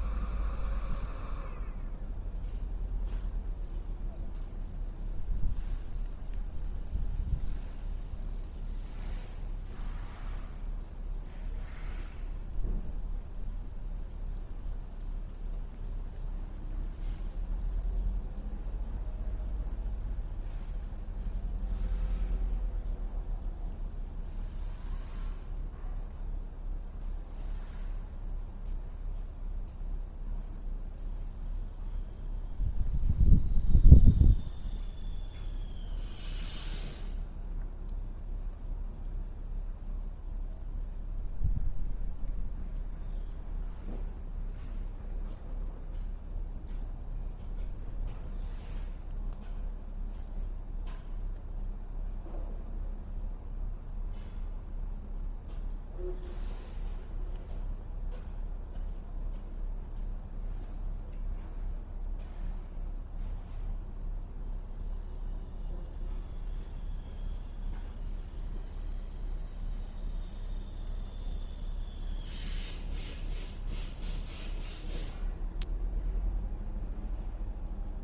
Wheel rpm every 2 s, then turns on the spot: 0, 0, 0, 0, 0, 0, 0, 0, 0, 0, 0, 0, 0, 0, 0, 0, 0, 0, 0, 0, 0, 0, 0, 0, 0, 0, 0, 0, 0, 0, 0, 0, 0, 0, 0, 0, 0, 0, 0.
none